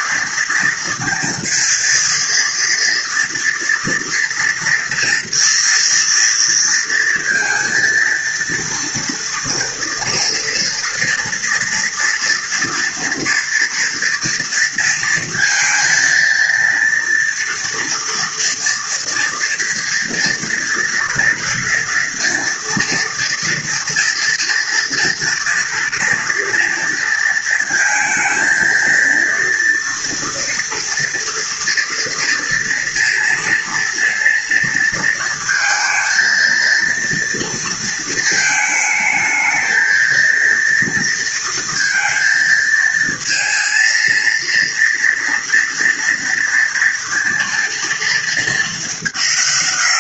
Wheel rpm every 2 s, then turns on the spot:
230, 230, 240, 230, 240, 230, 230, 230, 230, 240, 230, 230, 230, 230, 230, 230, 230, 230, 230, 220, 230, 230, 230, 230, 200.
none